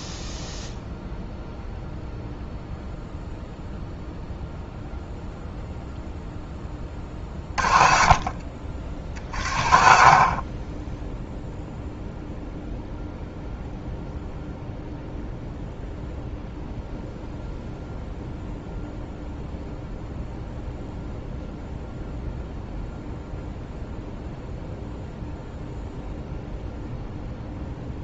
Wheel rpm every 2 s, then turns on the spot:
0, 0, 0, 20, 60, 30, 0, 0, 0, 0, 0, 0, 0, 0.
none